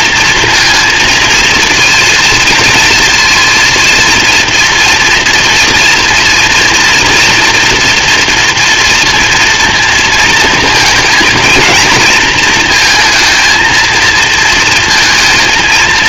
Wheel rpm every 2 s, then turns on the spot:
220, 230, 240, 230, 230, 230, 230, 230.
none